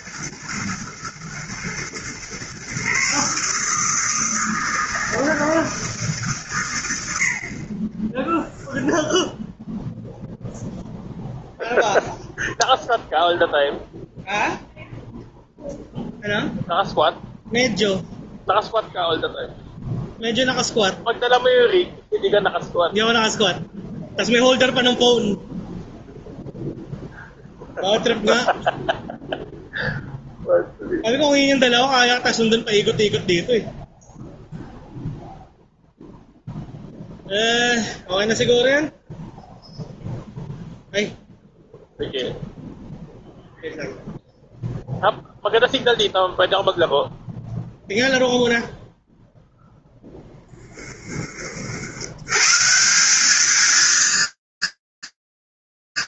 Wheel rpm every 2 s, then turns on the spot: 120, 120, 160, 160, 30, 0, 0, 0, 0, 0, 0, 0, 0, 0, 0, 0, 0, 0, 0, 0, 0, 0, 0, 0, 0, 0, 70, 220.
none